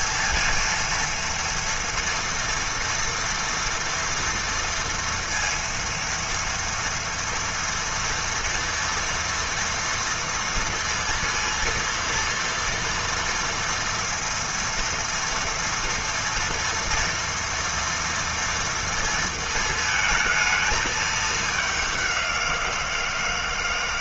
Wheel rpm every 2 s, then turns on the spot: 230, 230, 230, 230, 230, 230, 230, 230, 230, 230, 220, 170.
none